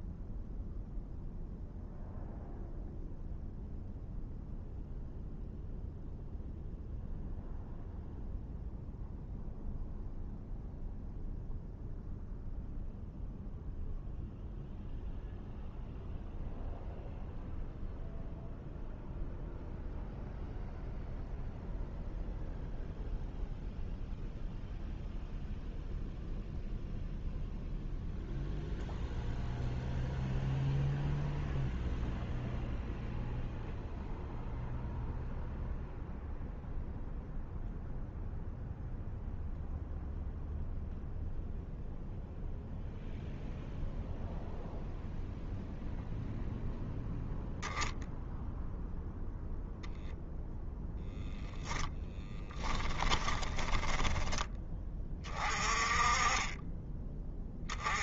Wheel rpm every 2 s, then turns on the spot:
0, 0, 0, 0, 0, 0, 0, 0, 0, 0, 0, 0, 0, 0, 0, 0, 0, 0, 0, 0, 0, 0, 0, 0, 0, 0, 20, 20, 20.
52-54